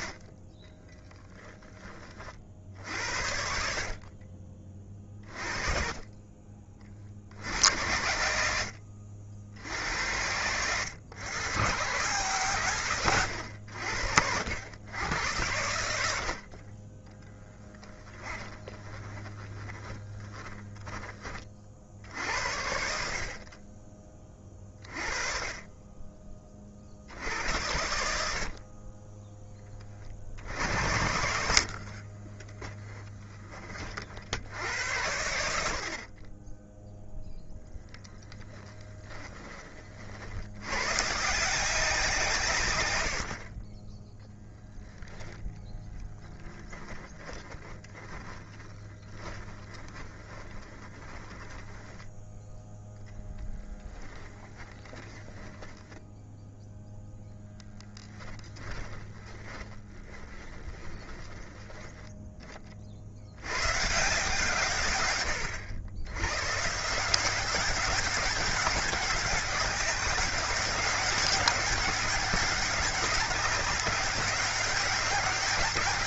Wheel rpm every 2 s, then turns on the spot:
30, 60, 40, 50, 80, 110, 120, 90, 30, 20, 10, 60, 30, 50, 20, 80, 20, 90, 10, 20, 120, 110, 0, 20, 20, 20, 10, 10, 0, 20, 20, 50, 130, 150, 190, 200, 200, 190.
0-2 18-20 30-32 38-40 46-52 58-62